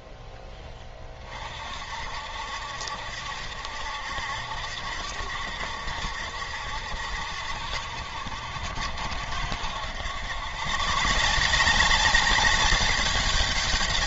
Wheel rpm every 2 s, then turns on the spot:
20, 70, 70, 80, 70, 120, 200.
none